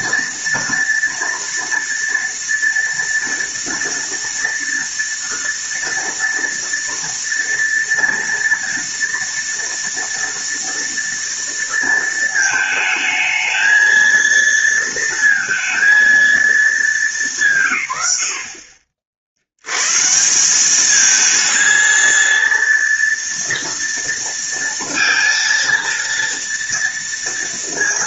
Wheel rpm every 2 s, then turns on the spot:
230, 230, 230, 230, 230, 230, 220, 230, 220, 50, 200, 230, 230, 230.
none